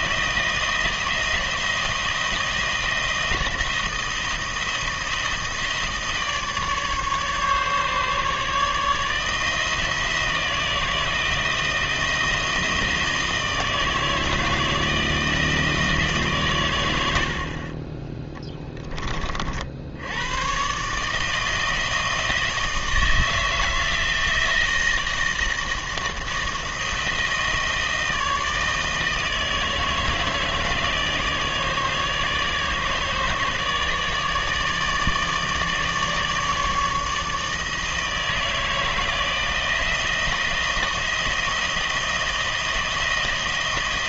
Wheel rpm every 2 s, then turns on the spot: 160, 160, 160, 150, 160, 160, 160, 160, 80, 30, 150, 160, 160, 160, 160, 160, 150, 160, 160, 160, 160, 160.
none